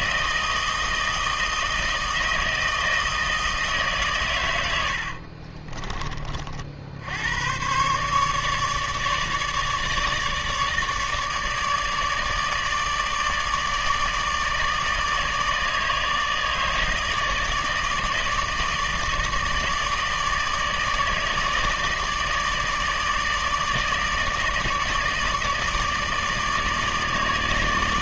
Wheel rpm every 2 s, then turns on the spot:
160, 160, 110, 50, 150, 150, 160, 160, 160, 160, 150, 150, 160, 150.
none